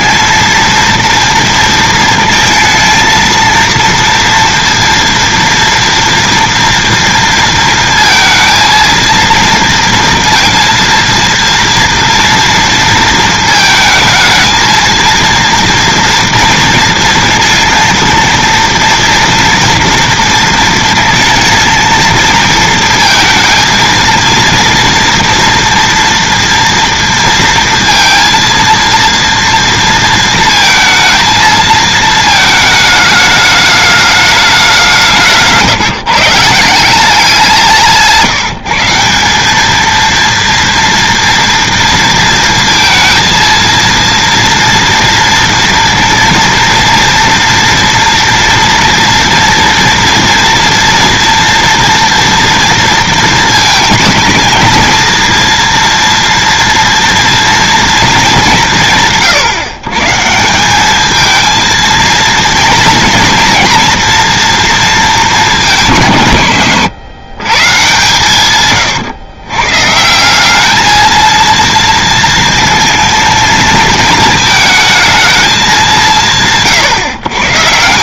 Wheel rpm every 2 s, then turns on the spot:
230, 220, 230, 230, 230, 230, 230, 230, 230, 230, 230, 230, 230, 230, 230, 230, 220, 200, 160, 160, 230, 230, 230, 230, 240, 230, 230, 230, 240, 180, 180, 230, 230, 120, 130, 210, 230, 220, 150.
68-70